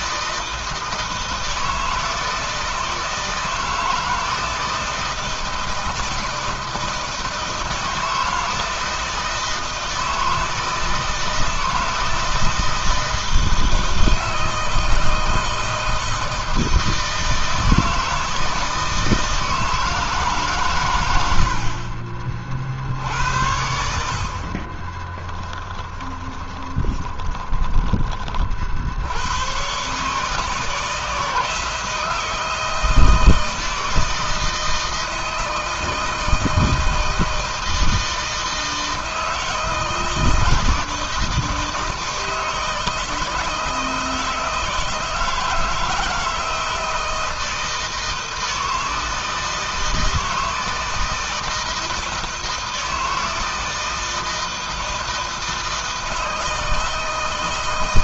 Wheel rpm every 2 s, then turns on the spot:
160, 160, 160, 160, 160, 160, 160, 160, 160, 160, 130, 50, 50, 20, 50, 160, 160, 160, 160, 160, 160, 160, 160, 160, 160, 160, 160, 160, 160.
24-28